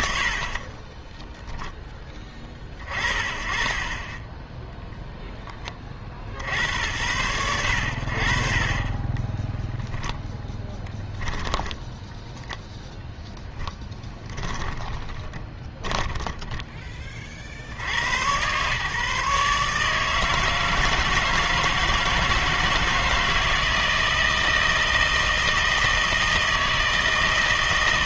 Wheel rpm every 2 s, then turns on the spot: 40, 30, 0, 70, 30, 10, 0, 10, 10, 130, 170, 160, 160, 160.
0-2 10-12 14-16